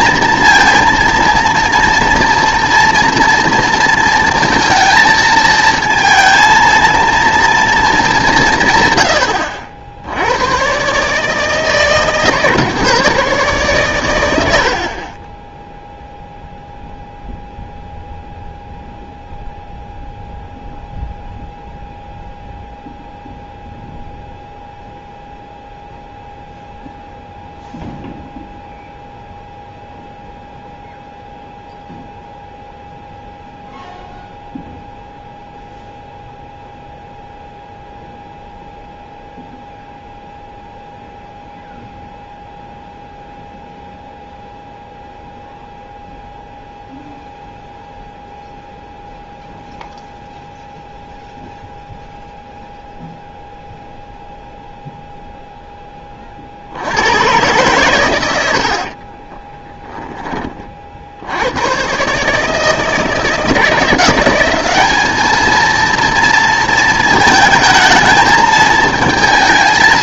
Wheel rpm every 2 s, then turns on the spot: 230, 230, 230, 230, 140, 120, 140, 70, 0, 0, 0, 0, 0, 0, 0, 0, 0, 0, 0, 0, 0, 0, 0, 0, 0, 0, 0, 0, 60, 80, 40, 160, 190, 230, 220.
none